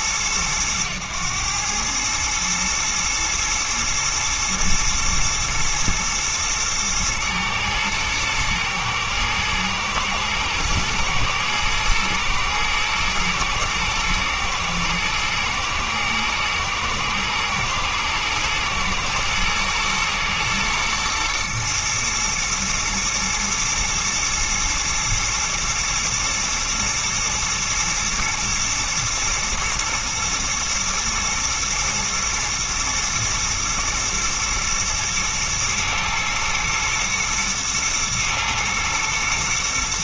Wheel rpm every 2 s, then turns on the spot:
110, 110, 110, 110, 110, 120, 110, 110, 110, 120, 120, 110, 120, 120, 110, 110, 110, 110, 110, 110.
none